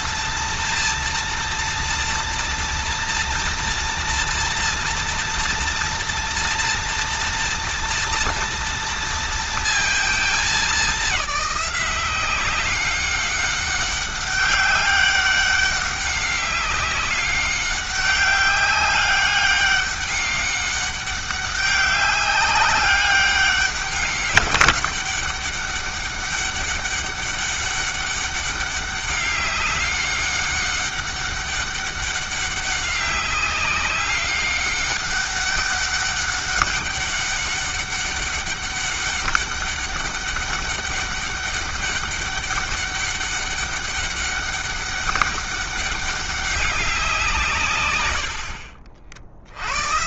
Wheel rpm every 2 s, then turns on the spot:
230, 230, 230, 230, 230, 200, 190, 200, 200, 200, 200, 200, 200, 200, 200, 200, 190, 200, 200, 200, 200, 200, 200, 180, 70.
none